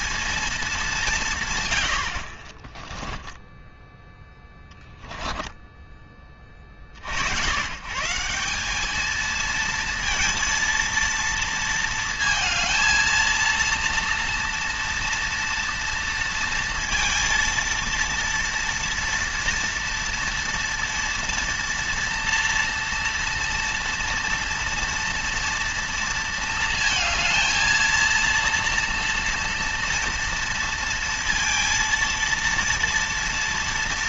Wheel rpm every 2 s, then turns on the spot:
200, 30, 10, 40, 190, 230, 220, 230, 230, 240, 230, 230, 230, 230, 230, 230, 230.
2-6